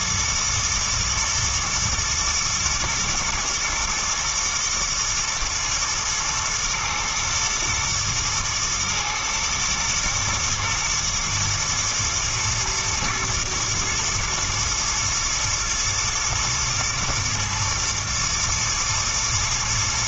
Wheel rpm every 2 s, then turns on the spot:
120, 120, 110, 120, 120, 110, 120, 110, 110, 110.
none